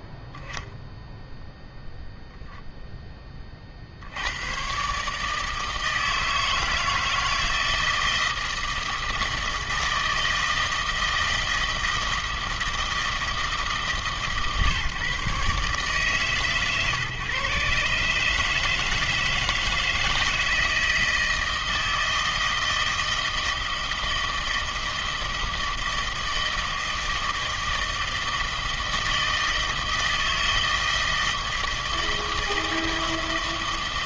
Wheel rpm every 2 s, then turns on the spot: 0, 0, 120, 160, 160, 160, 160, 140, 130, 150, 160, 160, 160, 160, 160, 160, 160.
none